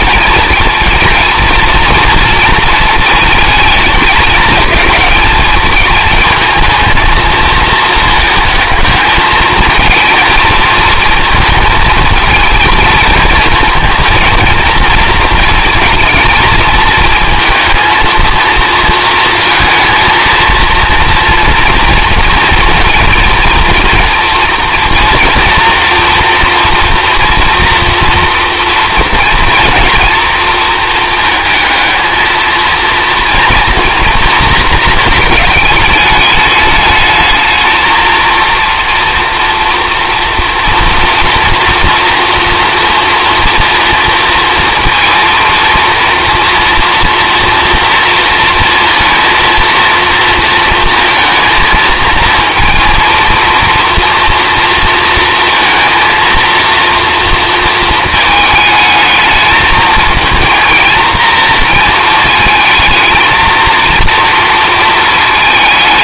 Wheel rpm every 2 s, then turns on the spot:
230, 220, 220, 220, 220, 230, 220, 230, 220, 230, 230, 230, 230, 230, 230, 220, 230, 230, 210, 230, 230, 230, 230, 230, 230, 230, 230, 230, 230, 220, 230, 220, 220.
none